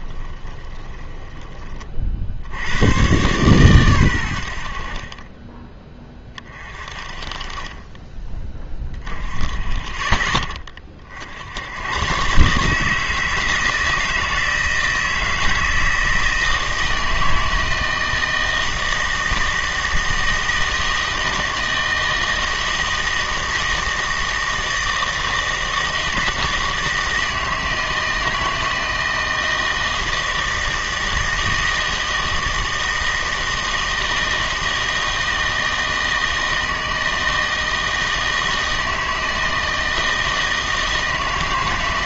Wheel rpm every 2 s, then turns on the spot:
20, 80, 60, 30, 10, 30, 150, 160, 160, 160, 160, 160, 160, 160, 160, 160, 160, 160, 160, 160, 160.
0-2